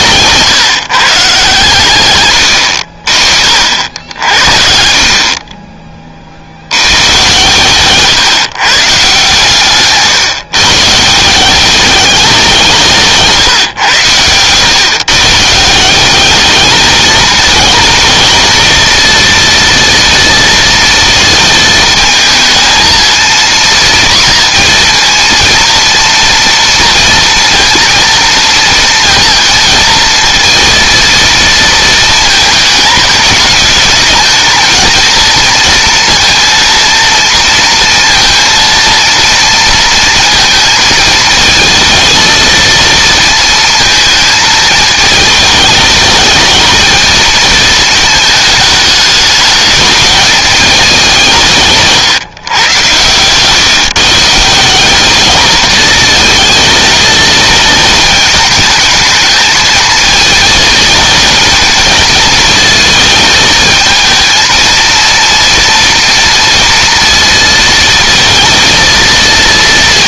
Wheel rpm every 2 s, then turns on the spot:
140, 50, 40, 100, 140, 160, 170, 130, 220, 230, 230, 230, 230, 230, 230, 230, 210, 230, 230, 230, 230, 230, 220, 220, 200, 180, 120, 200, 220, 220, 220, 220, 230, 230, 230.
none